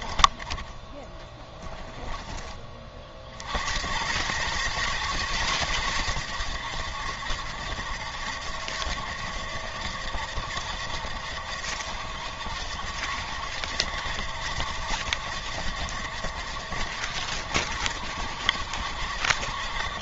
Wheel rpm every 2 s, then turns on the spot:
20, 30, 120, 90, 80, 80, 70, 70, 70, 70.
none